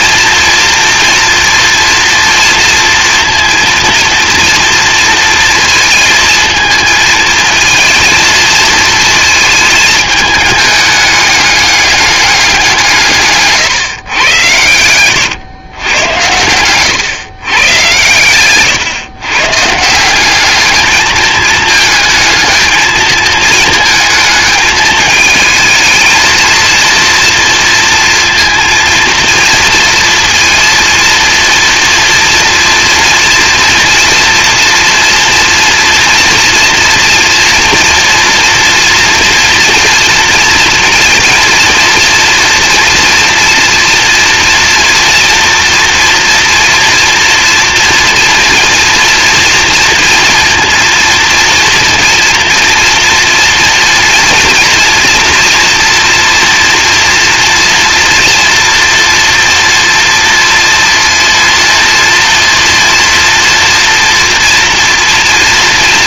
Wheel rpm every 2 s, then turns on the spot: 230, 230, 230, 230, 220, 210, 170, 100, 120, 130, 210, 220, 220, 230, 230, 230, 230, 240, 230, 230, 230, 240, 230, 230, 230, 230, 230, 230, 230, 230, 230, 230, 230.
none